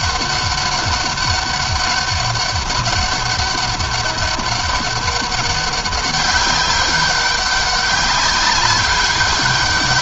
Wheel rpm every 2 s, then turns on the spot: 200, 200, 200, 190, 200.
none